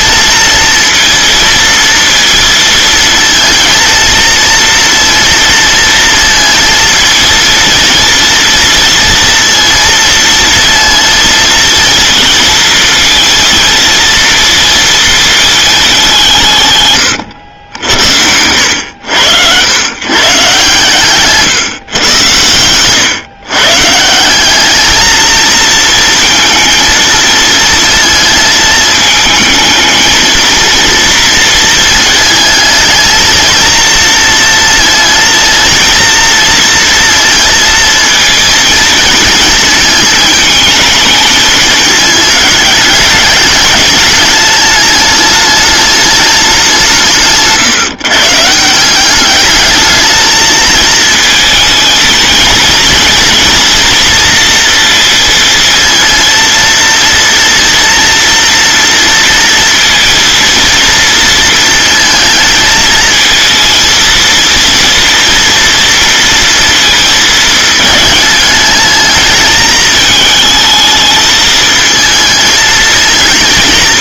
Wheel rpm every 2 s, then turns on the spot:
230, 230, 230, 230, 230, 230, 230, 230, 130, 90, 130, 110, 210, 230, 220, 230, 220, 230, 230, 220, 220, 210, 210, 190, 170, 220, 230, 230, 230, 230, 230, 220, 230, 230, 210, 220, 220.
none